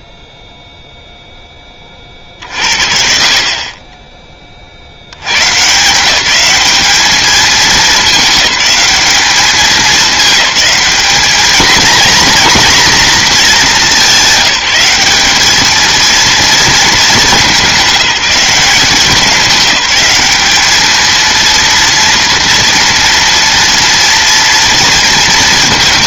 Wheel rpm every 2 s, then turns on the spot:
0, 40, 20, 190, 200, 210, 230, 210, 230, 190, 200, 230, 230.
none